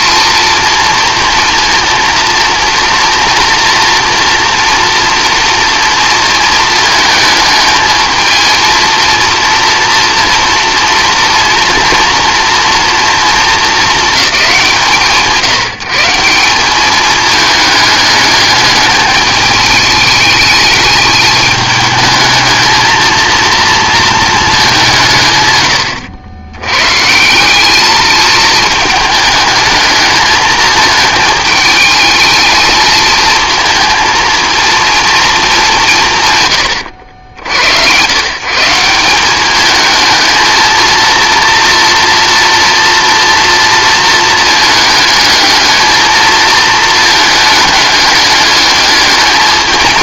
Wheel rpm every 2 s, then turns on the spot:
230, 230, 240, 220, 220, 240, 230, 190, 190, 210, 210, 220, 190, 110, 220, 220, 220, 230, 120, 160, 220, 230, 220, 220, 210.
none